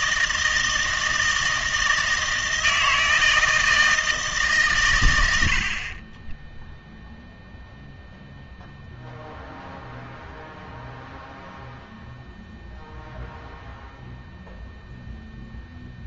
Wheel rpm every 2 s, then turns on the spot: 160, 160, 140, 10, 0, 0, 0, 0.
6-8